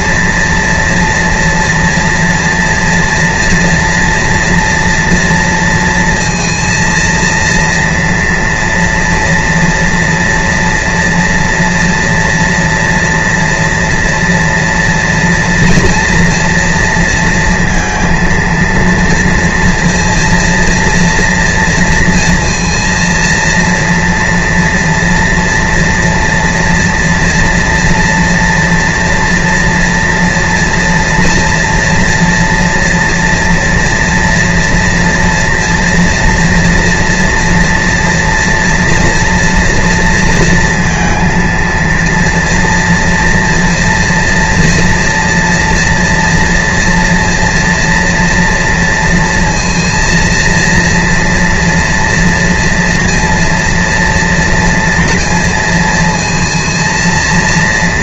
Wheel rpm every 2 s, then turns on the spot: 230, 230, 230, 230, 230, 230, 230, 230, 230, 230, 230, 230, 230, 230, 230, 230, 230, 240, 240, 230, 230, 230, 240, 230, 230, 230, 230, 230, 230.
none